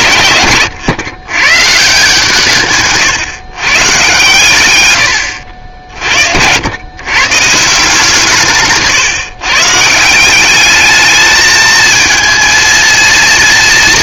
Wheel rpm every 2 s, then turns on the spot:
110, 150, 120, 100, 150, 200, 220.
none